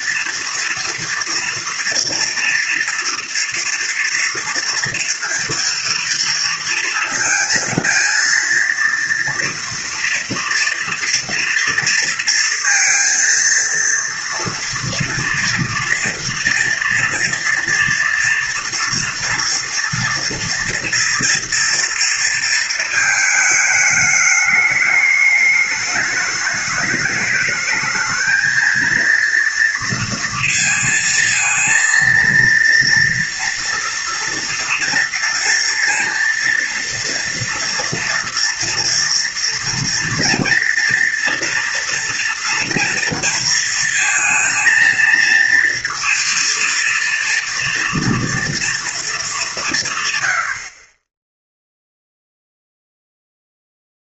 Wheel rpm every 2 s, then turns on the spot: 230, 230, 230, 230, 230, 230, 230, 230, 230, 230, 230, 230, 210, 210, 220, 230, 230, 230, 230, 230, 240, 230, 230, 230, 230, 70, 0.
none